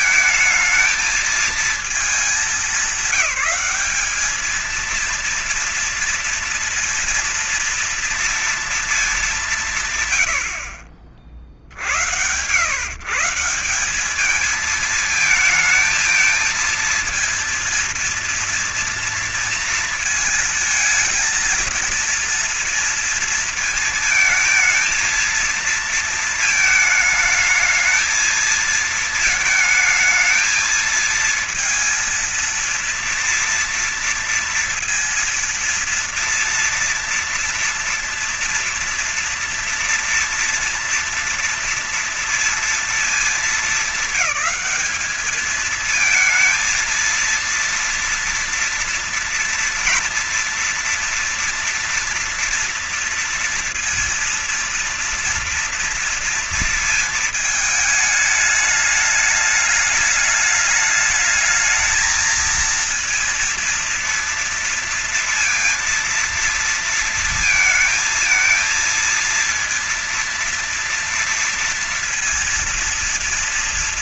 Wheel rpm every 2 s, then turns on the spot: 220, 200, 210, 230, 230, 90, 130, 210, 220, 230, 230, 230, 230, 220, 230, 220, 230, 230, 230, 230, 230, 230, 210, 220, 240, 230, 230, 230, 230, 210, 210, 220, 230, 230, 220, 240, 230.
none